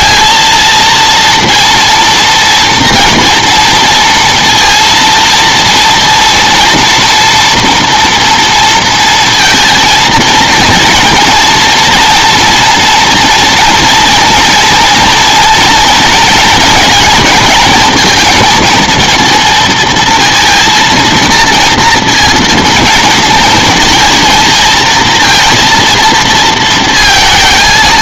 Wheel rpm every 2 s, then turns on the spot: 230, 230, 230, 240, 230, 230, 240, 240, 230, 230, 230, 230, 230, 230.
none